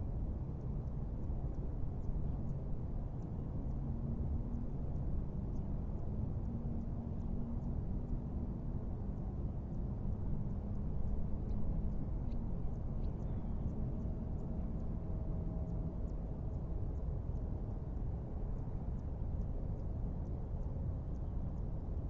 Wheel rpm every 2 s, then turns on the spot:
0, 0, 0, 0, 0, 0, 0, 0, 0, 0, 0.
none